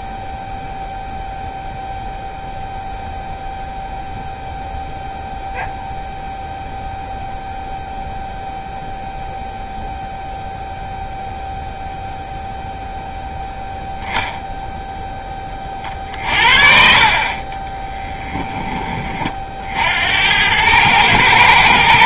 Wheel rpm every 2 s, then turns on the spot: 0, 0, 0, 0, 0, 0, 0, 0, 50, 30, 110.
none